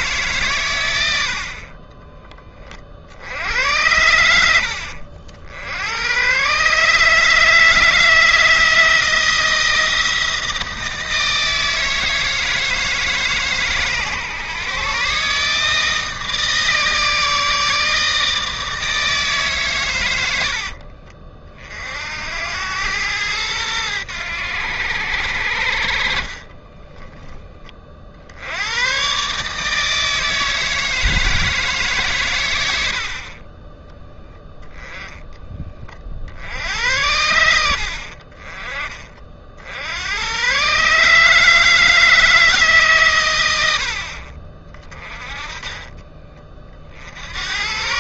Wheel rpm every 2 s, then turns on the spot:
120, 40, 70, 130, 160, 160, 160, 140, 150, 160, 60, 100, 90, 30, 90, 160, 100, 10, 80, 30, 130, 150, 30, 40.
20-22 26-28